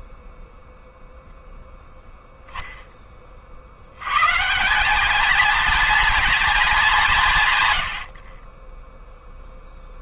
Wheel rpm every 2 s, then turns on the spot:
0, 180, 200, 20, 10.
none